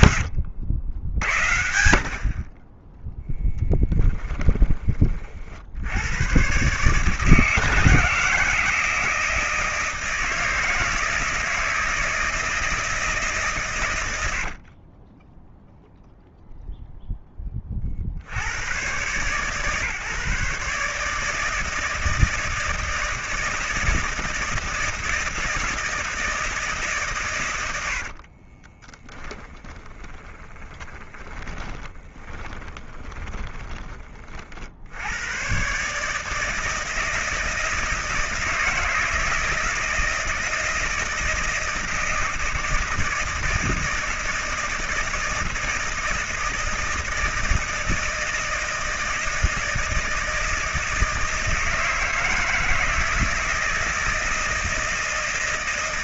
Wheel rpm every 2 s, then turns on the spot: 80, 20, 20, 130, 160, 160, 160, 50, 0, 110, 150, 160, 160, 150, 30, 30, 20, 60, 160, 160, 160, 170, 160, 160, 160, 160, 160, 160.
14-16 28-34